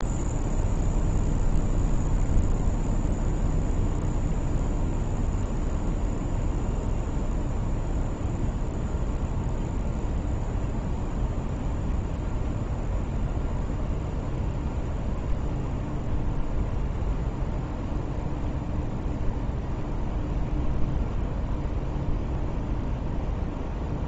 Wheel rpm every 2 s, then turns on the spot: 0, 0, 0, 0, 0, 0, 0, 0, 0, 0, 0, 0.
none